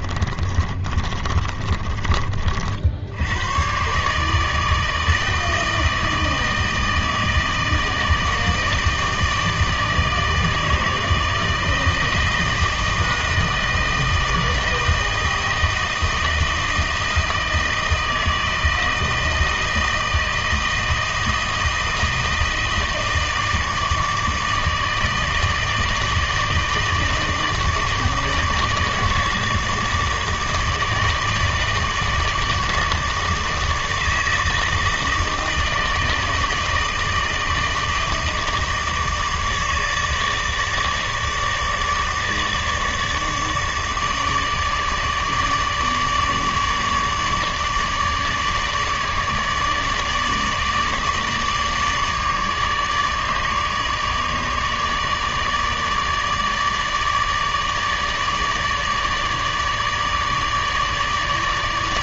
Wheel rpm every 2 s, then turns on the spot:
30, 60, 150, 160, 160, 160, 160, 160, 160, 160, 160, 160, 160, 160, 150, 160, 160, 160, 160, 160, 150, 150, 150, 150, 150, 150, 150, 150, 150, 150, 150.
0-2